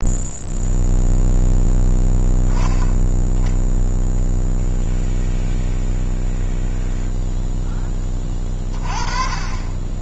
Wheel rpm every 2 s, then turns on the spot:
0, 0, 0, 0, 20.
none